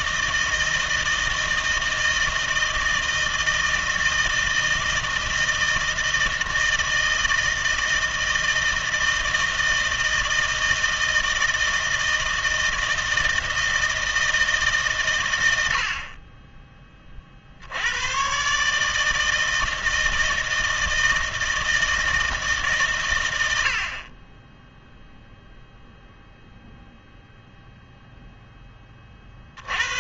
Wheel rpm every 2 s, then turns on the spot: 160, 160, 160, 160, 160, 160, 160, 150, 20, 140, 160, 140, 10, 0, 10.
none